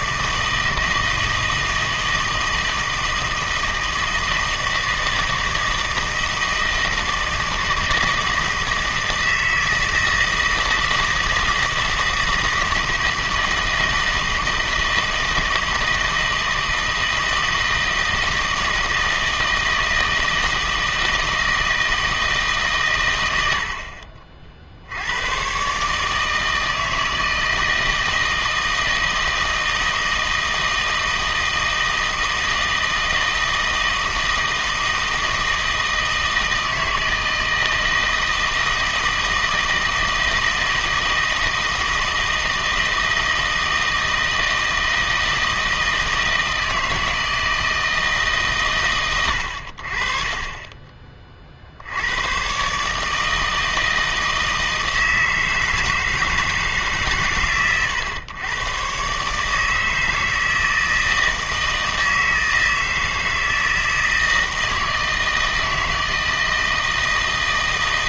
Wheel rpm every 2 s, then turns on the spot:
160, 160, 160, 160, 160, 160, 160, 160, 160, 160, 160, 140, 60, 160, 160, 160, 160, 160, 160, 160, 160, 160, 160, 160, 120, 20, 130, 160, 160, 110, 160, 160, 160, 160.
none